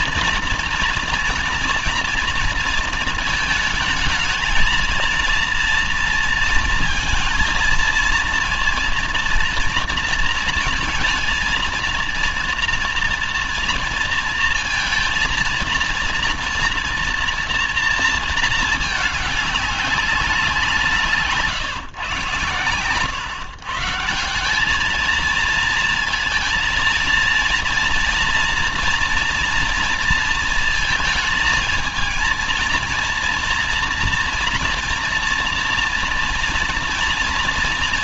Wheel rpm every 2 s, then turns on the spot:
230, 230, 230, 230, 230, 230, 230, 230, 240, 210, 150, 120, 220, 230, 240, 220, 230, 230, 230.
none